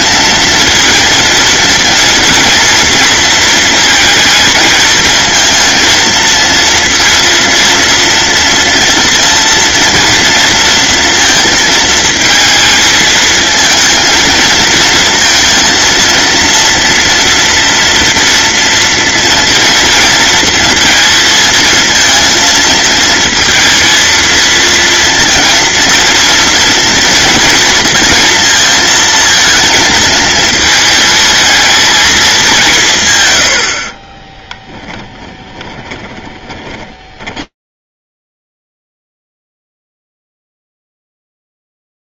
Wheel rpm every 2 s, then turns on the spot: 230, 230, 220, 230, 230, 230, 220, 230, 230, 230, 230, 230, 230, 230, 230, 220, 160, 10, 20, 0, 0.
34-38